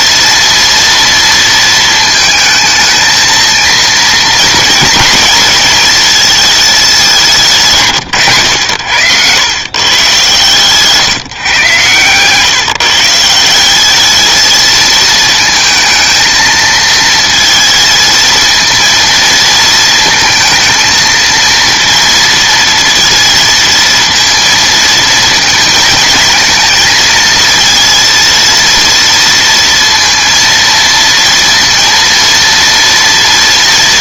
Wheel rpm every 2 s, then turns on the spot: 230, 220, 230, 220, 110, 140, 150, 230, 230, 230, 220, 230, 230, 230, 230, 230, 230.
10-12